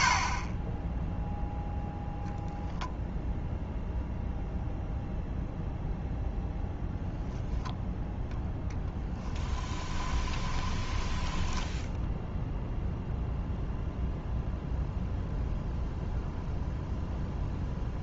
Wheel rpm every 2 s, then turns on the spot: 20, 0, 0, 0, 0, 10, 0, 0, 0.
10-12